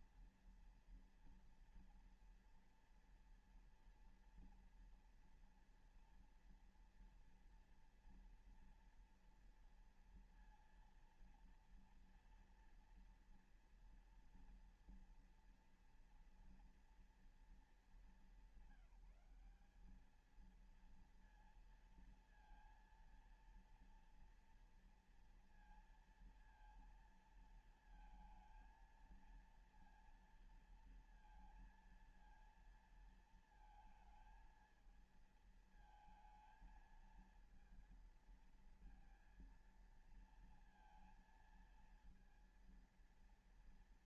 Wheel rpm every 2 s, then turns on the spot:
230, 230, 230, 230, 230, 230, 230, 230, 230, 200, 220, 230, 240, 230, 220, 230, 230, 220, 220, 230, 230, 230.
none